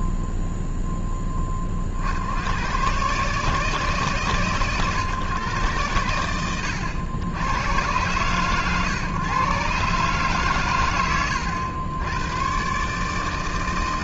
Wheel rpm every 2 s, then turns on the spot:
0, 130, 120, 90, 130, 80, 150.
none